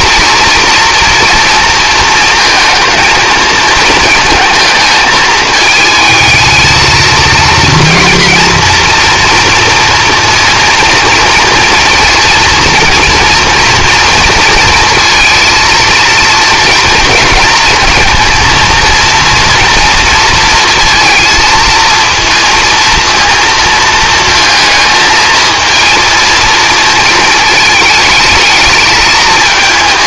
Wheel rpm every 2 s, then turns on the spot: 230, 230, 220, 230, 240, 230, 230, 230, 230, 230, 230, 230, 220, 230, 210.
none